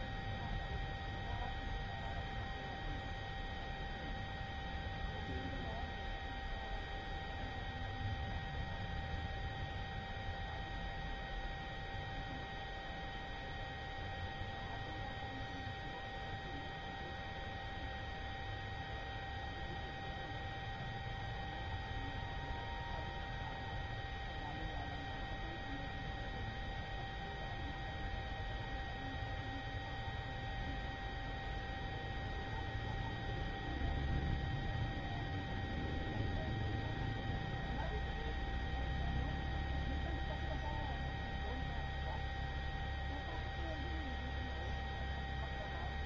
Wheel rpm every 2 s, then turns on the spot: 0, 0, 0, 0, 0, 0, 0, 0, 0, 0, 0, 0, 0, 0, 0, 0, 0, 0, 0, 0, 0, 0, 0.
none